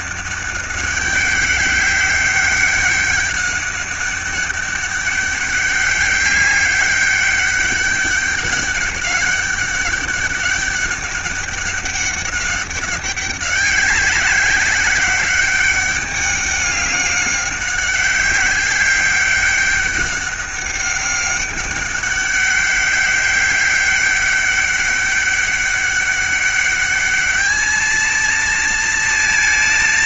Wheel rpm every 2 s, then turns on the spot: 200, 200, 200, 200, 200, 200, 200, 190, 200, 200, 200, 200, 200, 200, 230.
none